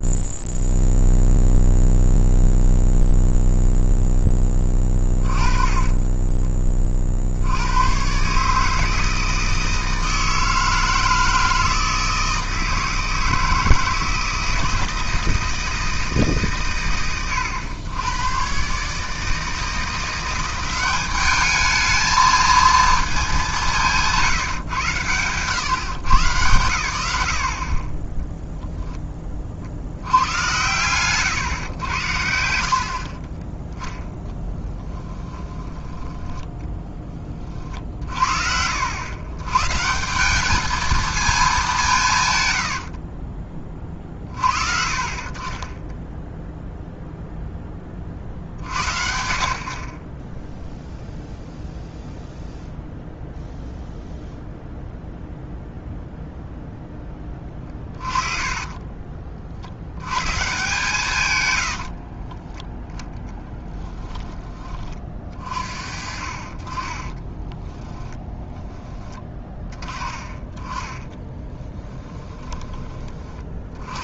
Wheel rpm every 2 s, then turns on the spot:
0, 0, 10, 20, 150, 160, 160, 160, 130, 120, 190, 220, 130, 100, 0, 100, 70, 10, 10, 70, 210, 100, 40, 0, 50, 0, 0, 0, 0, 30, 140, 10, 20, 30, 10, 20, 20.
4-6 34-36 66-68 70-74